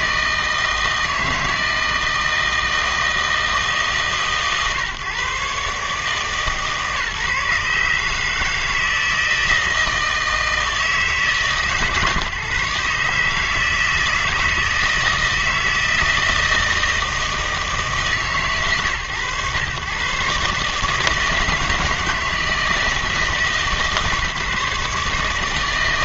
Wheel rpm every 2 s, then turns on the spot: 160, 160, 140, 140, 160, 160, 140, 160, 160, 130, 150, 160, 150.
none